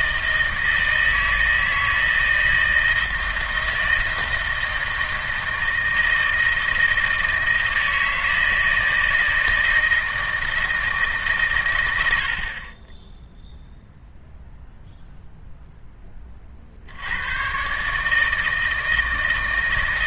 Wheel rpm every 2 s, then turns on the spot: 160, 160, 160, 160, 160, 160, 50, 0, 40, 160.
none